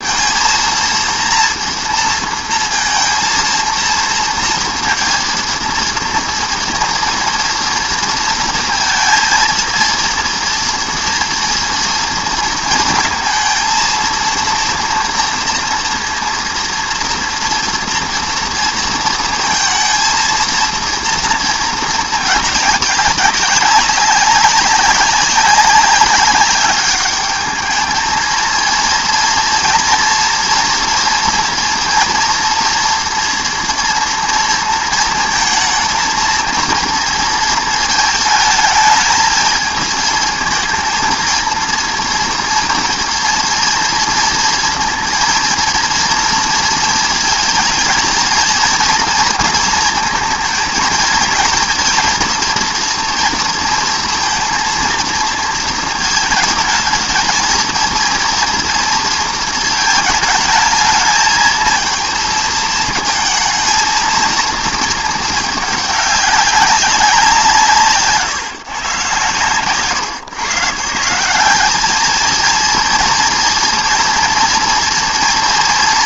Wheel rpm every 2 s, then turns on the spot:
230, 230, 230, 230, 230, 230, 230, 230, 230, 230, 230, 210, 200, 200, 220, 230, 240, 230, 230, 220, 220, 230, 230, 230, 230, 230, 230, 230, 220, 230, 220, 220, 230, 190, 140, 150, 230, 240.
none